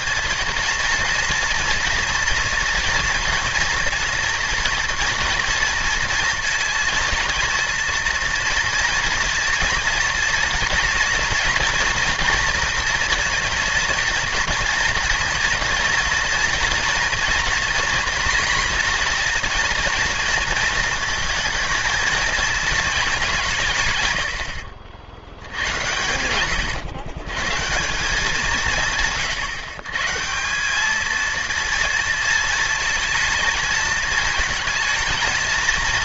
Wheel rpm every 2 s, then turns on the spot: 230, 240, 230, 230, 230, 240, 240, 230, 230, 230, 230, 230, 60, 110, 160, 190, 230, 220.
none